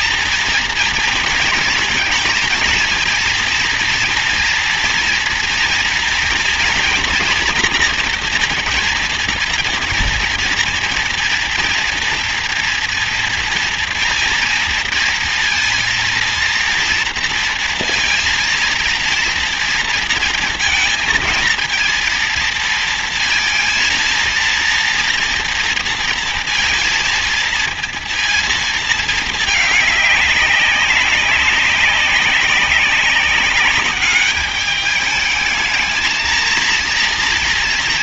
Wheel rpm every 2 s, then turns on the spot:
230, 230, 230, 230, 230, 240, 230, 230, 230, 230, 230, 230, 230, 230, 220, 200, 190, 200, 220.
none